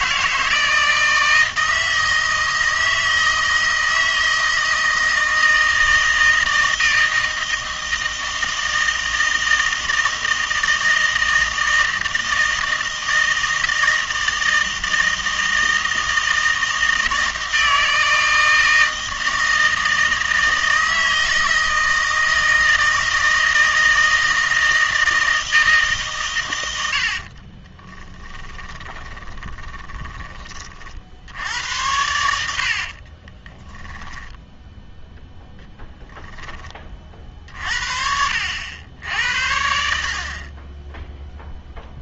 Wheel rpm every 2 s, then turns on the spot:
160, 160, 160, 160, 160, 160, 160, 160, 160, 160, 160, 160, 160, 90, 20, 30, 60, 10, 10, 80, 20.
28-30